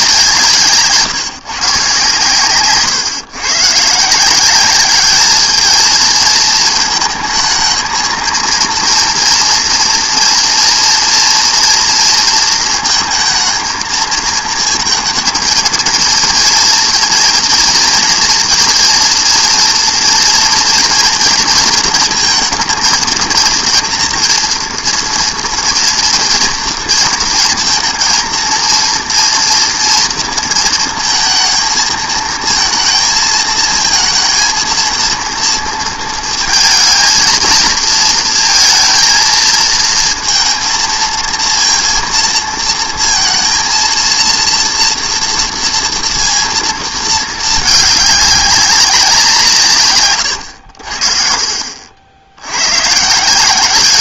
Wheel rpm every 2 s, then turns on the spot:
170, 130, 190, 220, 230, 230, 230, 230, 230, 230, 230, 220, 230, 240, 230, 220, 220, 230, 220, 230, 230, 230, 230, 230, 190, 90, 100.
50-52